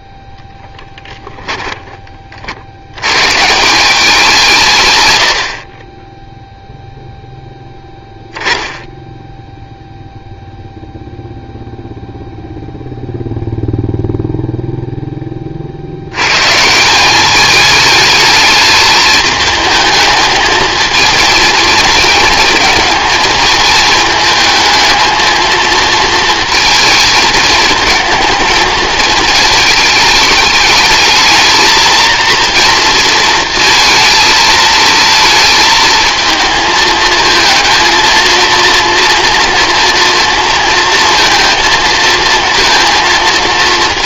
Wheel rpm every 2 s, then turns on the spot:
10, 60, 150, 0, 10, 0, 0, 0, 140, 210, 220, 220, 220, 230, 220, 210, 230, 230, 220, 230, 230, 230.
0-2